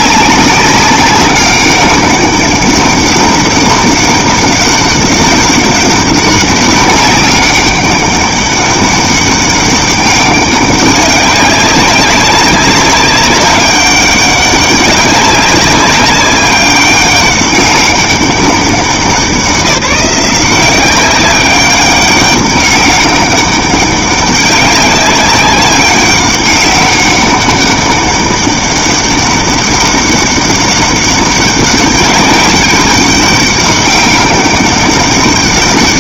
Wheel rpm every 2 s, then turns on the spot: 190, 200, 200, 190, 200, 200, 200, 200, 200, 190, 180, 200, 190, 200, 200, 200, 190, 200.
none